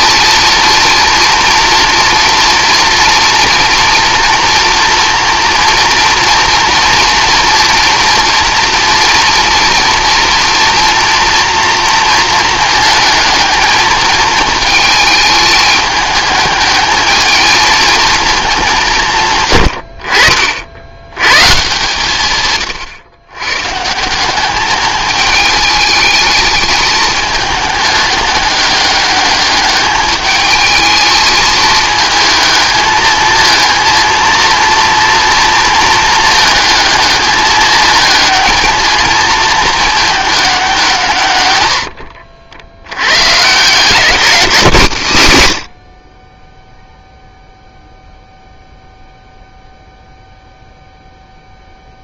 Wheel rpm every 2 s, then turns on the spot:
230, 230, 230, 240, 230, 230, 220, 220, 210, 170, 80, 120, 210, 210, 200, 220, 220, 230, 220, 220, 190, 80, 160, 0, 0, 0.
none